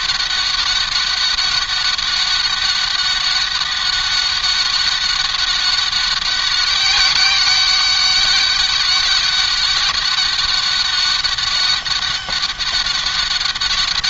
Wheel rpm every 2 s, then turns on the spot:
200, 200, 200, 190, 200, 200, 200.
none